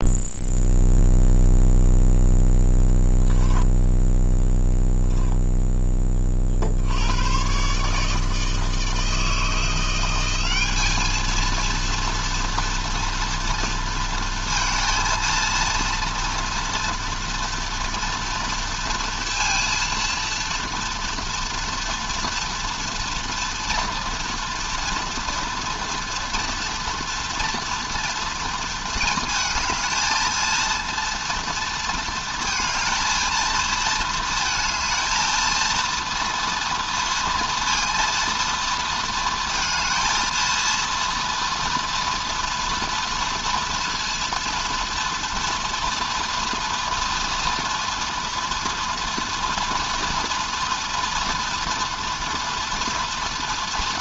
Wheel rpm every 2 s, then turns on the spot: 0, 10, 0, 80, 160, 210, 230, 230, 230, 230, 230, 230, 230, 230, 230, 230, 230, 220, 230, 230, 230, 240, 230, 230, 230, 230, 230.
none